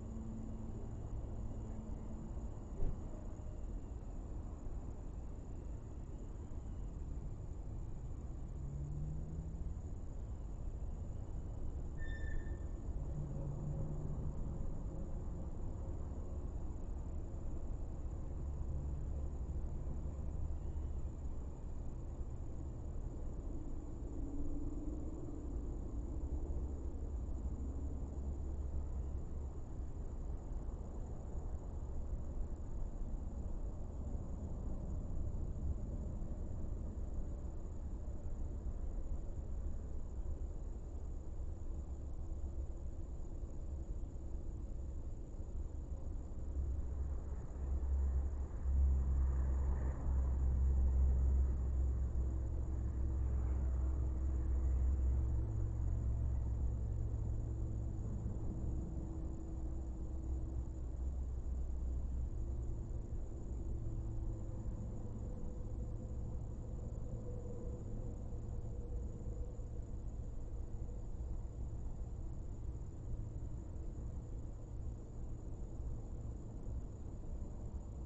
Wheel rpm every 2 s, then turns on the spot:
0, 0, 0, 0, 0, 0, 0, 0, 0, 0, 0, 0, 0, 0, 0, 0, 0, 0, 0, 0, 0, 0, 0, 0, 0, 0, 0, 0, 0, 0, 0, 0, 0, 0, 0, 0, 0, 0, 0.
none